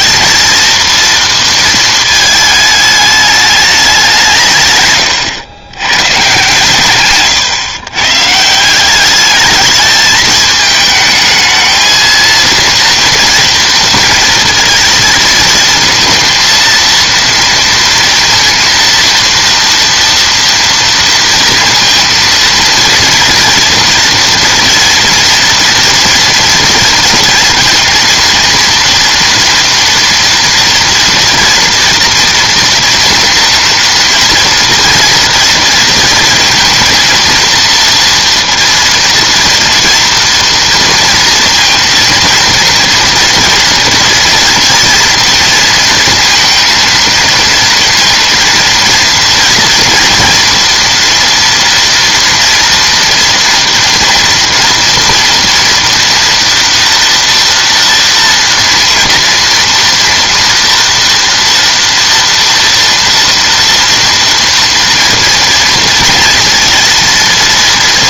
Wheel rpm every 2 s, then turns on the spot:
230, 210, 110, 120, 210, 220, 230, 220, 230, 230, 230, 230, 230, 230, 230, 230, 240, 230, 230, 230, 230, 230, 230, 230, 240, 230, 230, 240, 230, 240, 230, 230, 230, 230.
none